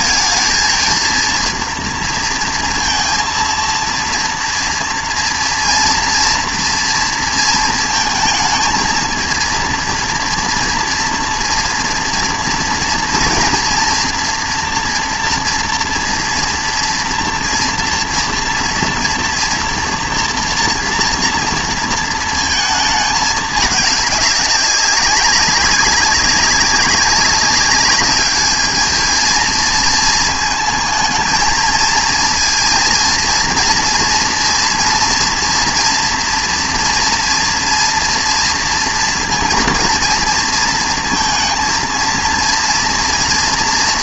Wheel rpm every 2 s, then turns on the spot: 220, 230, 230, 230, 220, 230, 230, 240, 240, 230, 240, 220, 200, 190, 220, 220, 230, 230, 230, 230, 230, 230.
none